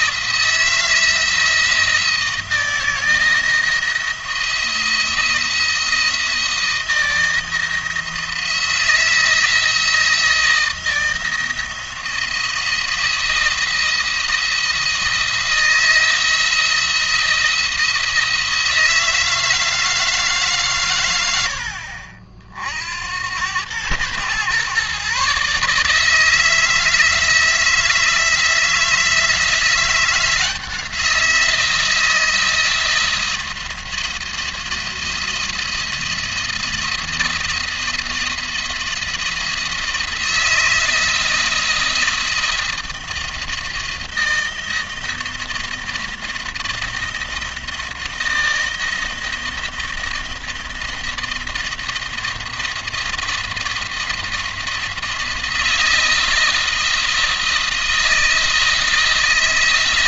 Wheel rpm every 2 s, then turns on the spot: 170, 170, 170, 160, 170, 160, 170, 170, 170, 160, 120, 70, 130, 160, 160, 170, 170, 170, 170, 170, 160, 170, 170, 170, 160, 170, 170, 160, 160, 160.
none